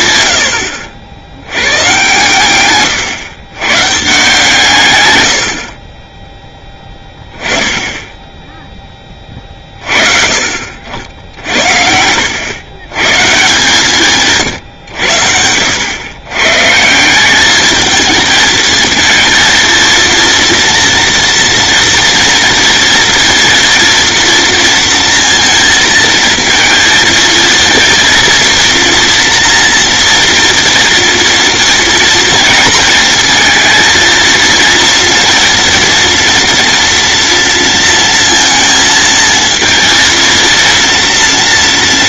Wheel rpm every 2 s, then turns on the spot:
70, 130, 120, 10, 20, 60, 120, 90, 170, 230, 230, 230, 230, 230, 230, 240, 230, 230, 230, 230, 230.
none